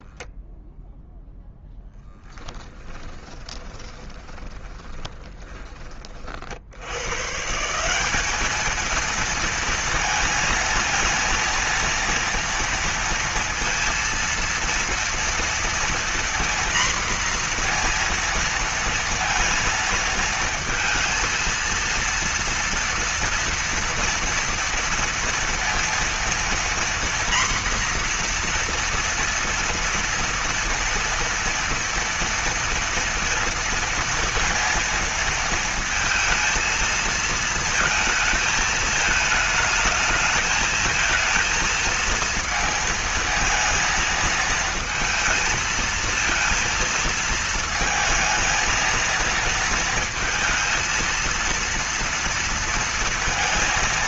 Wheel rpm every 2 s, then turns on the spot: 0, 20, 20, 100, 220, 230, 230, 230, 240, 230, 230, 230, 230, 240, 240, 240, 230, 230, 220, 220, 220, 230, 220, 230, 220, 230, 230.
2-6